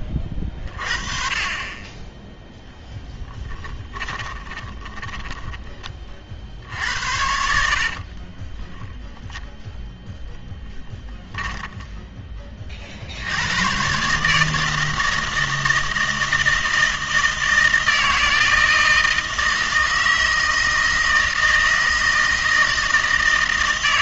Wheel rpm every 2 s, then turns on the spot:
30, 0, 20, 70, 10, 10, 40, 160, 160, 160, 160, 160.
4-6 8-12